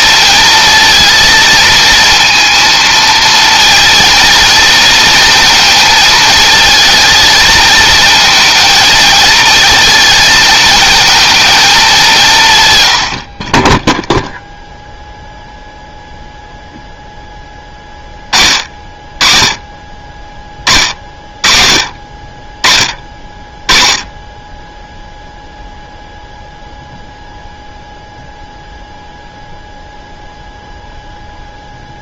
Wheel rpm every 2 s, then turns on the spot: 220, 230, 230, 220, 230, 220, 80, 0, 10, 30, 40, 20, 0, 0, 0, 0.
none